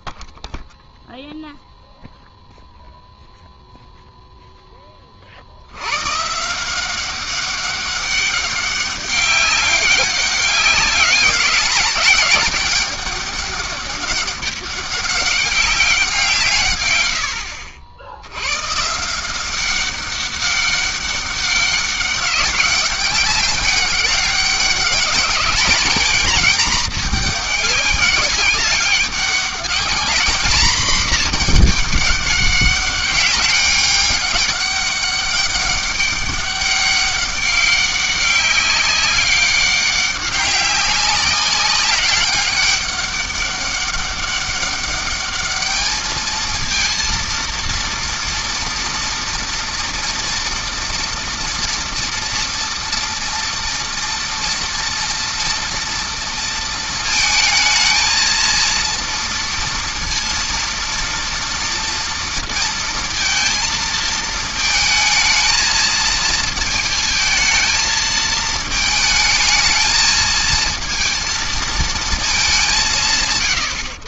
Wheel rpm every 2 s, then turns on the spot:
0, 10, 170, 200, 200, 200, 200, 130, 130, 200, 200, 200, 220, 200, 220, 200, 200, 200, 200, 200, 200, 200, 230, 230, 230, 230, 230, 230, 220, 230, 230, 220, 220, 220, 220, 220, 130.
none